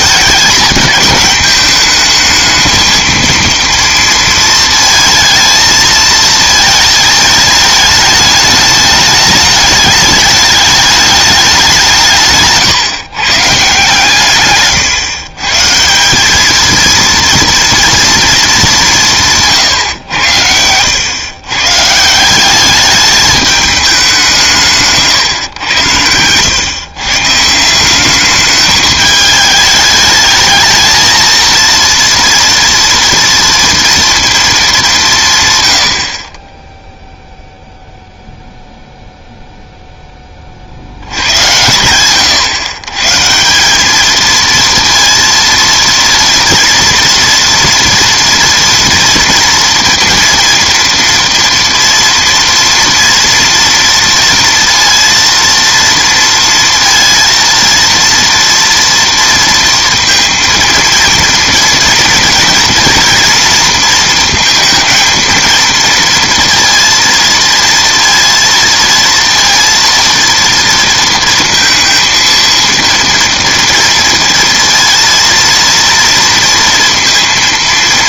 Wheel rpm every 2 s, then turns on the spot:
210, 220, 230, 230, 210, 210, 150, 130, 210, 200, 90, 200, 160, 120, 210, 220, 230, 210, 20, 0, 50, 120, 230, 230, 230, 230, 230, 230, 230, 230, 230, 230, 220, 230, 230, 230, 230, 230, 230.
12-14